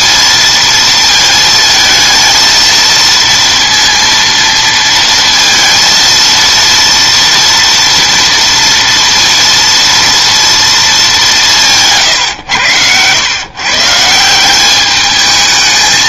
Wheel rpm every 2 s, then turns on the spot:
230, 230, 230, 230, 230, 220, 100, 190.
none